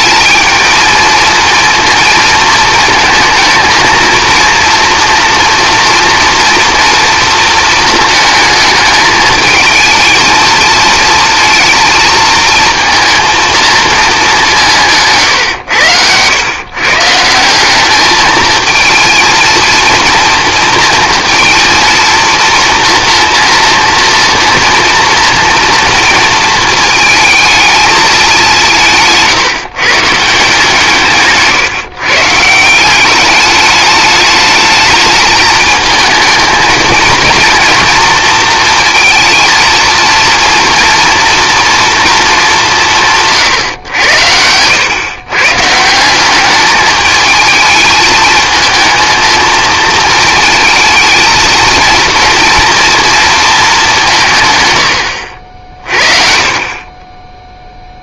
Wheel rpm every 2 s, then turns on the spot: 220, 230, 230, 230, 220, 230, 230, 180, 130, 220, 230, 230, 230, 220, 200, 150, 170, 210, 230, 230, 230, 180, 110, 210, 230, 220, 230, 110, 40.
none